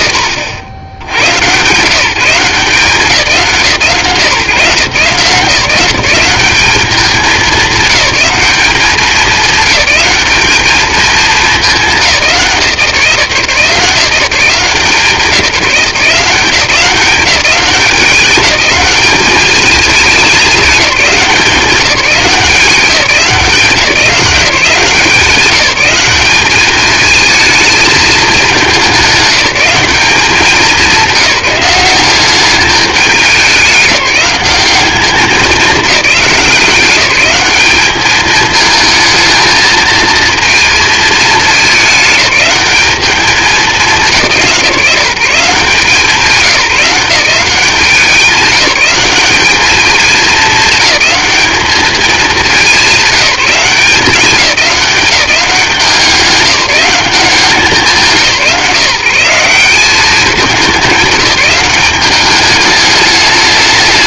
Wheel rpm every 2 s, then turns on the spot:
80, 170, 140, 210, 210, 220, 170, 170, 180, 200, 200, 180, 180, 210, 200, 200, 210, 200, 190, 220, 230, 200, 170, 170, 200, 210, 200, 200, 200, 170, 190, 210.
none